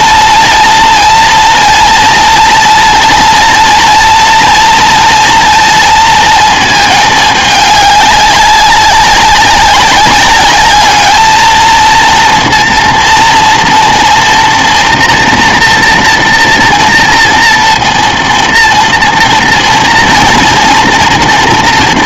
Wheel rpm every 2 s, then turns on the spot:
230, 230, 230, 220, 190, 210, 230, 240, 230, 230, 230.
none